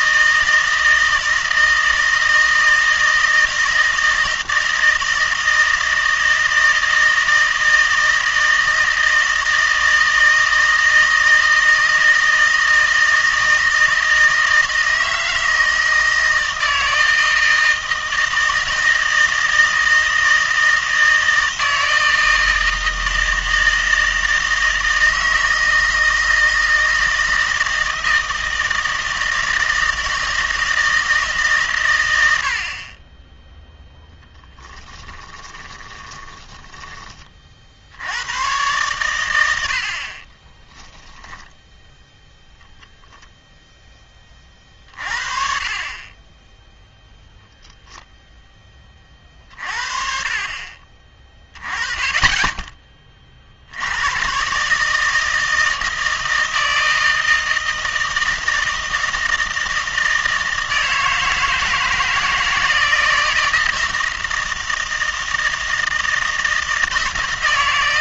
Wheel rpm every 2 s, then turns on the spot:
160, 160, 160, 160, 160, 160, 160, 160, 160, 160, 160, 160, 160, 160, 160, 160, 50, 10, 10, 120, 10, 0, 40, 0, 20, 30, 20, 150, 160, 160, 160, 160, 160, 160.
34-38